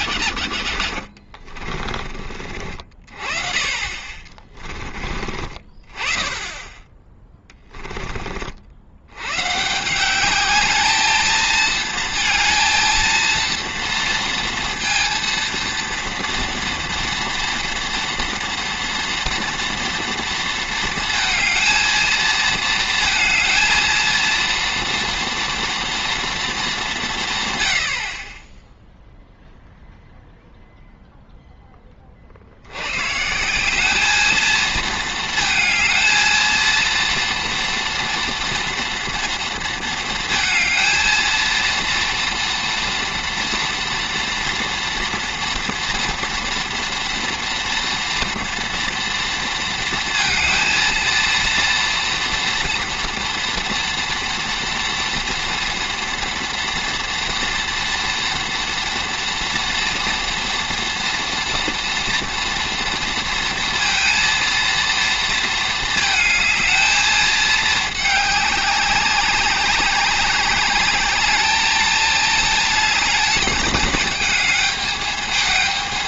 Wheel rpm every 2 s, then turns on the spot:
60, 40, 20, 10, 70, 210, 230, 230, 230, 230, 230, 230, 230, 200, 10, 0, 100, 220, 230, 230, 230, 230, 230, 230, 230, 230, 230, 230, 230, 230, 230, 230, 230, 220, 190, 200, 220, 220.
none